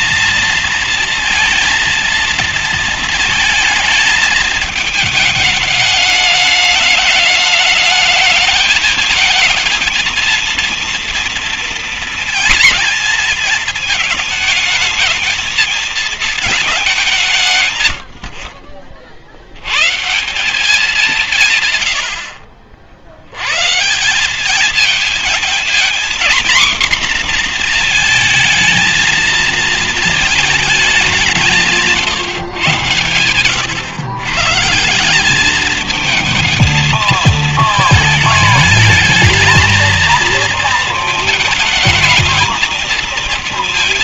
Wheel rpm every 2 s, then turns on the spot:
220, 230, 220, 210, 220, 230, 230, 220, 220, 60, 180, 50, 200, 250, 220, 210, 120, 150, 220, 210, 230, 230.
none